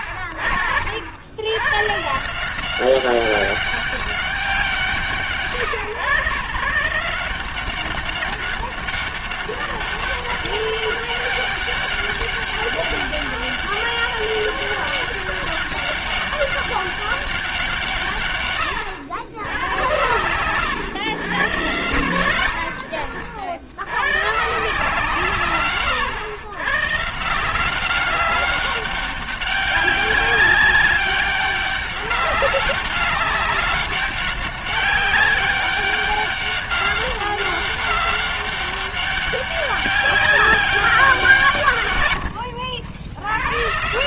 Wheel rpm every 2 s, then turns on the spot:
40, 180, 200, 140, 200, 200, 200, 200, 200, 120, 120, 60, 140, 120, 200, 200, 200, 200, 200, 200, 200, 80.
42-44